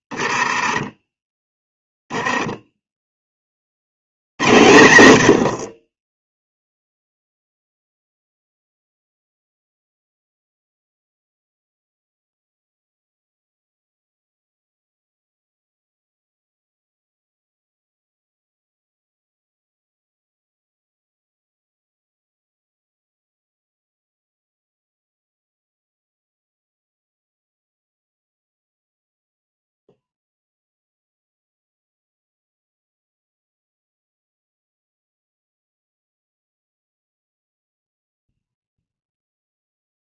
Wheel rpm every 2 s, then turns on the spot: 10, 10, 90, 0, 0, 0, 0, 0, 0, 0, 0, 0, 0, 0, 0, 0, 0, 0, 0, 0.
none